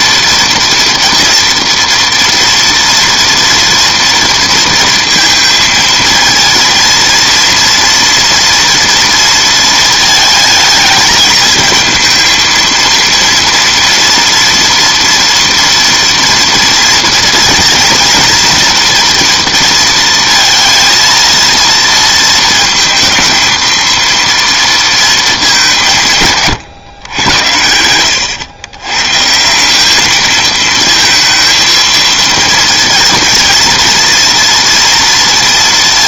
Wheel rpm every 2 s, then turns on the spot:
230, 230, 230, 230, 240, 220, 230, 230, 230, 230, 230, 230, 230, 140, 110, 220, 230, 240.
none